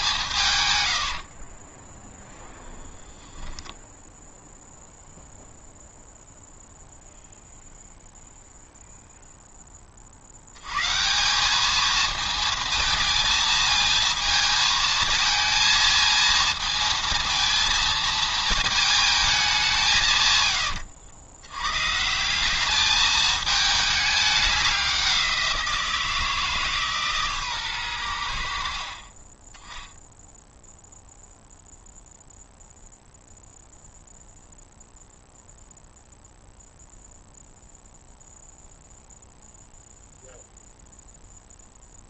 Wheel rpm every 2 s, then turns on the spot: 80, 10, 0, 0, 0, 150, 220, 230, 230, 220, 80, 210, 190, 140, 30, 0, 0, 0, 0, 0, 0.
0-2